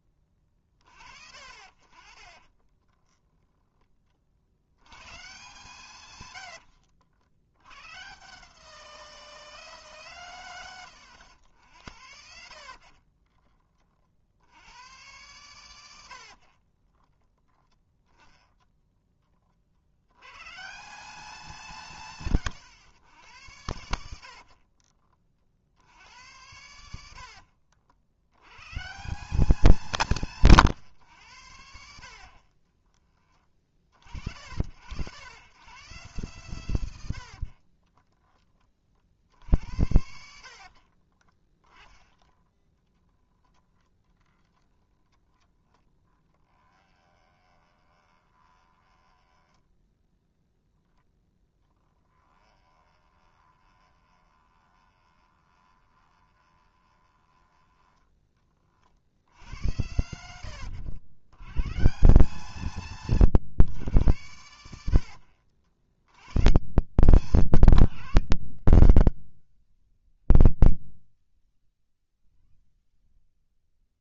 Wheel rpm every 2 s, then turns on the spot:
40, 30, 90, 60, 180, 120, 50, 120, 30, 10, 150, 110, 40, 110, 130, 140, 30, 80, 120, 50, 50, 10, 10, 20, 10, 0, 20, 20, 20, 50, 90, 140, 90, 120, 140, 100, 30.
2-4 6-8 12-14 16-18 24-28 32-34 36-38 40-42 46-50 52-58 70-72